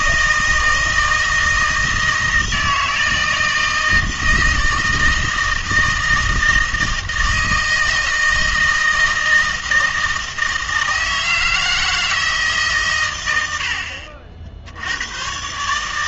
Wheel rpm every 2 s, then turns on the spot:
160, 160, 160, 160, 160, 160, 130, 80.
none